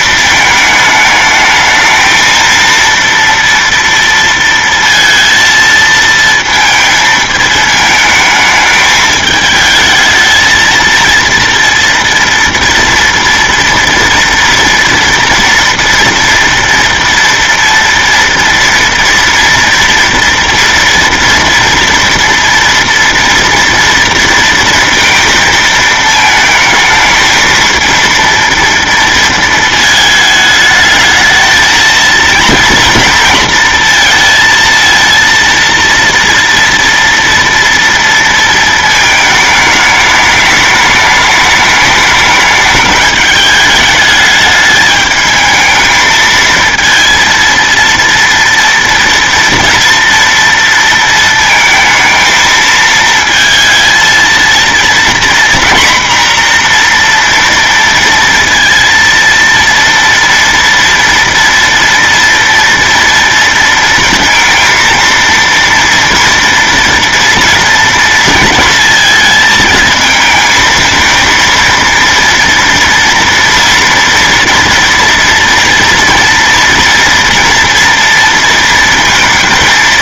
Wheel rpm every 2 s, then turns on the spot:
220, 230, 230, 220, 220, 220, 240, 230, 230, 230, 230, 230, 230, 220, 230, 210, 230, 230, 230, 220, 210, 210, 210, 230, 230, 230, 220, 230, 240, 230, 230, 230, 230, 240, 230, 220, 230, 230, 230, 230.
none